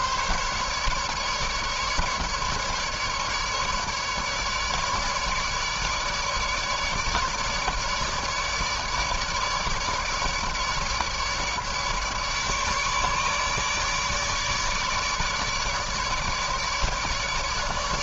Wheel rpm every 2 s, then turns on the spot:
150, 150, 150, 150, 150, 150, 150, 150, 150.
none